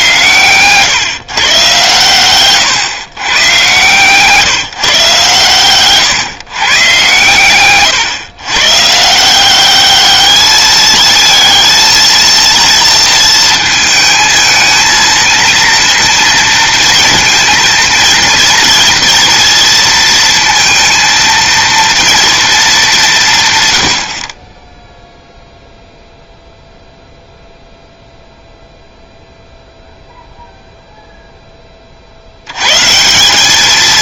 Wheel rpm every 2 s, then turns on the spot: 130, 120, 150, 130, 140, 220, 230, 220, 230, 230, 230, 210, 10, 0, 0, 0, 130.
none